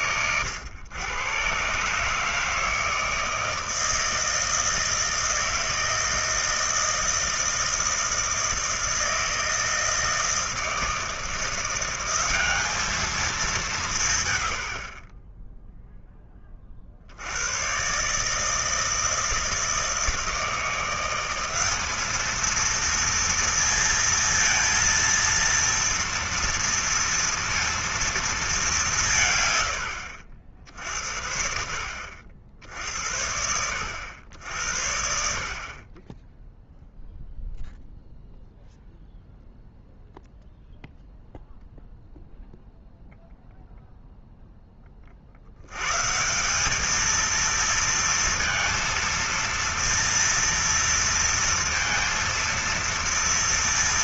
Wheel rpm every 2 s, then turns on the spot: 110, 160, 160, 160, 160, 160, 210, 70, 50, 160, 170, 220, 230, 230, 200, 70, 70, 70, 0, 0, 0, 0, 20, 210, 230, 230, 230.
none